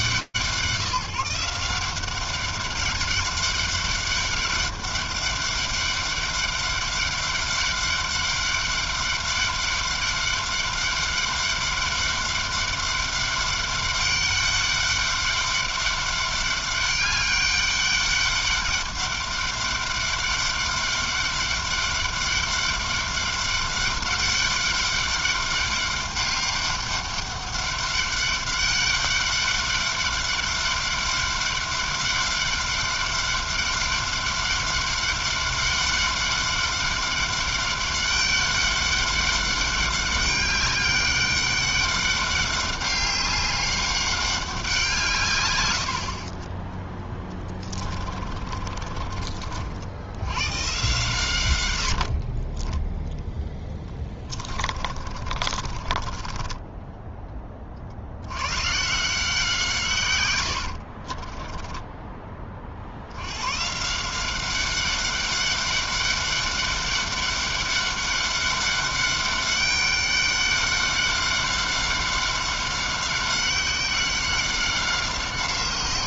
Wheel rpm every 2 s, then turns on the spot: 170, 200, 200, 200, 200, 200, 200, 200, 200, 200, 200, 200, 200, 200, 200, 200, 200, 200, 200, 200, 200, 200, 130, 10, 40, 110, 10, 30, 10, 160, 20, 90, 200, 200, 200, 200, 190, 170.
46-48 54-56 60-62